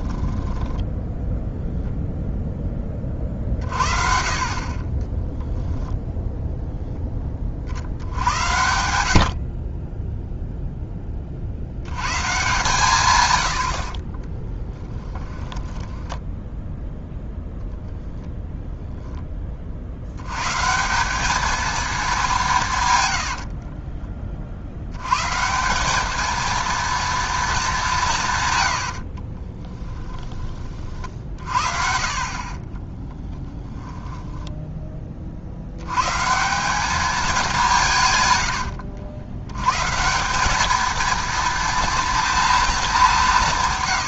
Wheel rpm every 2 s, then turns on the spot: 10, 0, 50, 0, 70, 0, 140, 20, 10, 0, 110, 190, 40, 220, 150, 20, 50, 10, 150, 110, 180, 230.
0-2 14-18 32-36